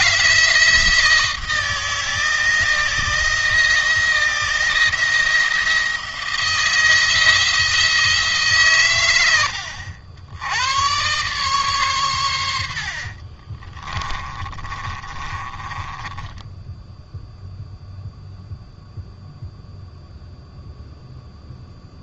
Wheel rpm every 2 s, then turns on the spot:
160, 160, 170, 160, 130, 110, 70, 30, 10, 0, 0.
12-18